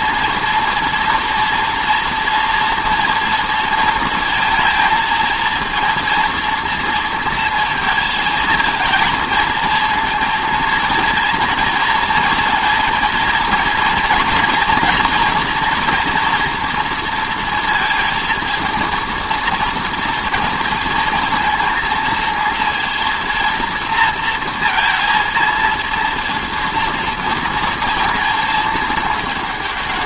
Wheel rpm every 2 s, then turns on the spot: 230, 240, 230, 230, 230, 230, 230, 240, 230, 230, 230, 230, 230, 230, 220.
none